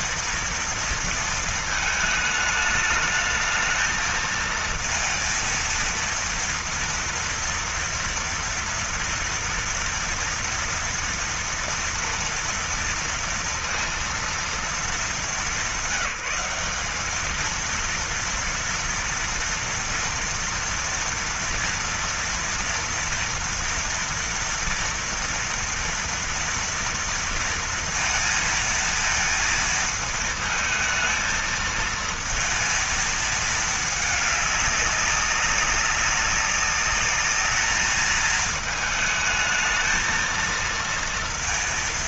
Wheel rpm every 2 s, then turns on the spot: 230, 220, 230, 230, 230, 230, 230, 220, 200, 230, 230, 230, 230, 230, 230, 220, 220, 200, 190, 220, 230.
none